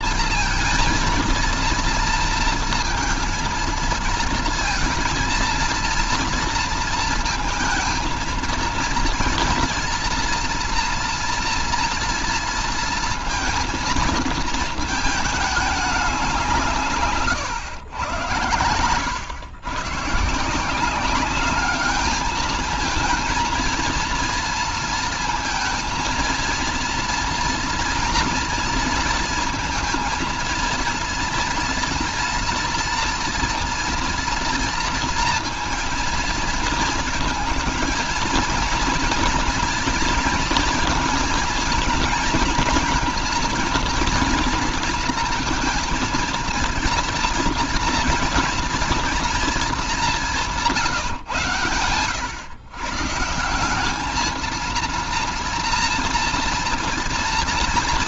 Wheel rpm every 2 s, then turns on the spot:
230, 230, 230, 230, 230, 230, 230, 220, 180, 110, 150, 220, 230, 230, 230, 230, 230, 230, 230, 230, 230, 230, 230, 230, 230, 200, 110, 220, 230.
none